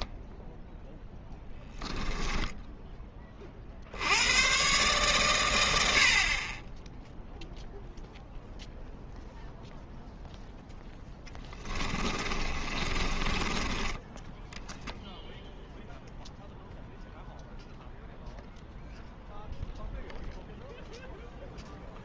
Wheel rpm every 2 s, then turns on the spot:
0, 10, 120, 20, 0, 10, 30, 0, 0, 0, 0.
2-4 12-14